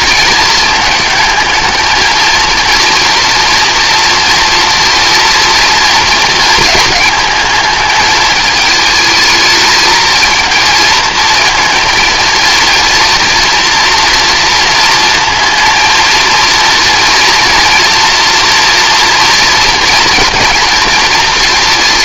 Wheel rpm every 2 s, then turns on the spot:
220, 230, 230, 220, 220, 230, 240, 230, 230, 240, 220.
none